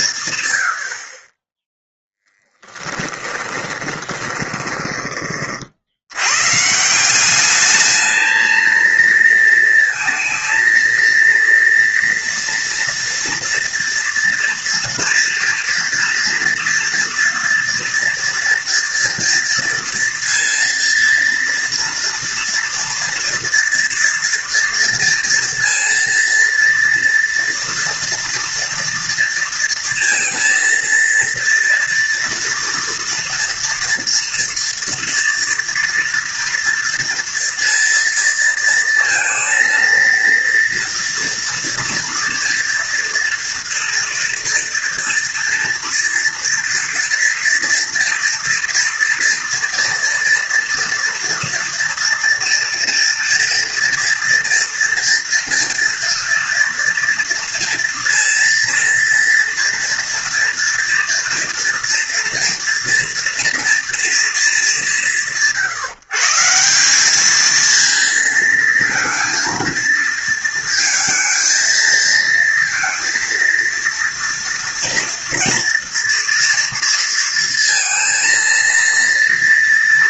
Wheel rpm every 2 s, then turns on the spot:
70, 20, 20, 150, 230, 230, 230, 240, 230, 230, 230, 230, 230, 230, 230, 230, 230, 230, 230, 230, 230, 230, 230, 230, 230, 230, 230, 230, 230, 230, 230, 230, 160, 180, 230, 220, 230, 230, 230, 230.
2-6